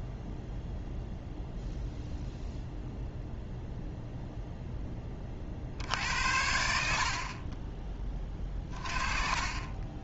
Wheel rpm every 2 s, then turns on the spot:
0, 0, 0, 60, 30.
none